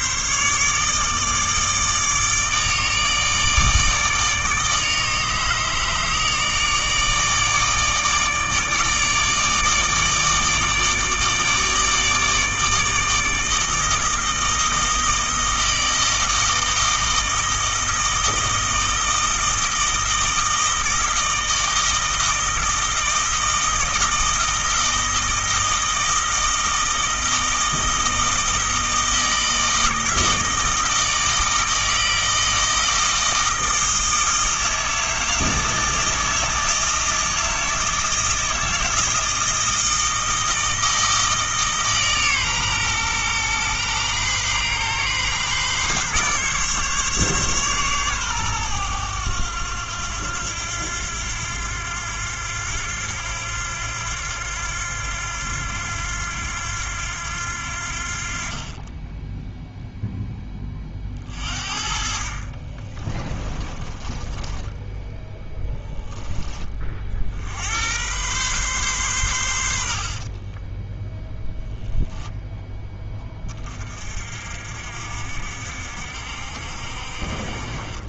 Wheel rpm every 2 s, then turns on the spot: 150, 160, 150, 150, 150, 160, 160, 160, 160, 160, 160, 160, 160, 160, 160, 160, 160, 160, 160, 160, 160, 130, 130, 140, 110, 90, 90, 90, 90, 40, 20, 30, 10, 30, 120, 20, 10, 50, 60.
62-66 70-72